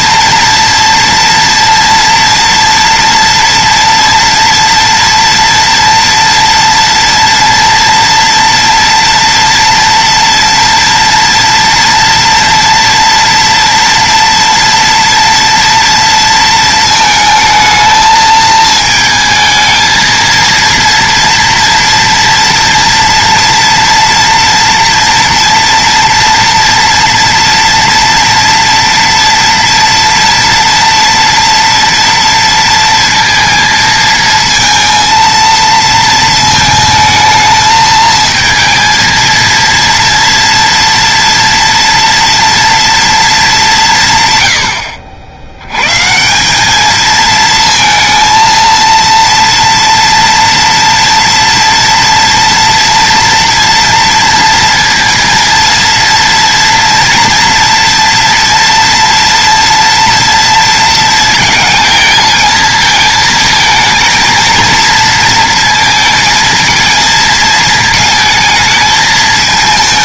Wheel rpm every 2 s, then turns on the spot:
230, 230, 230, 230, 230, 240, 230, 230, 230, 220, 230, 230, 240, 230, 230, 230, 230, 230, 220, 230, 230, 230, 70, 210, 230, 230, 230, 230, 230, 230, 230, 230, 230, 220, 220.
none